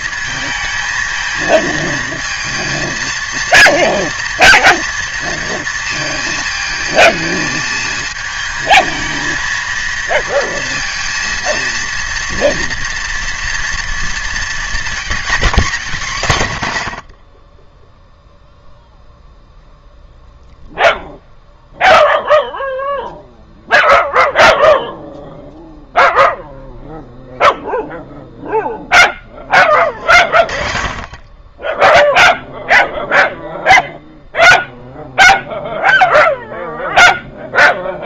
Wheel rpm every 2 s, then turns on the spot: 220, 230, 230, 220, 220, 230, 240, 230, 100, 0, 0, 0, 0, 0, 10, 30, 0, 0, 0.
none